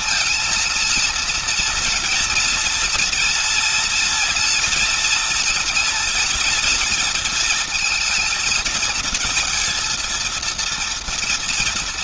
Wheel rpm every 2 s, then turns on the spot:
230, 240, 230, 230, 220, 230.
none